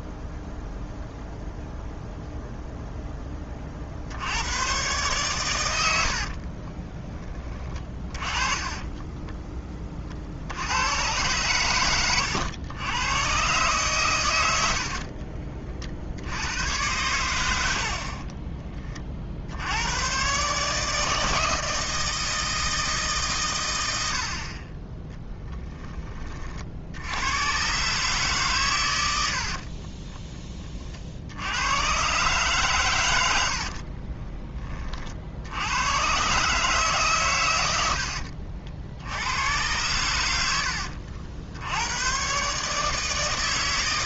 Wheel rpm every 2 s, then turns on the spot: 0, 0, 120, 30, 20, 90, 100, 60, 100, 30, 150, 150, 20, 80, 110, 30, 120, 30, 140, 70, 80, 150.
6-10 14-16 40-42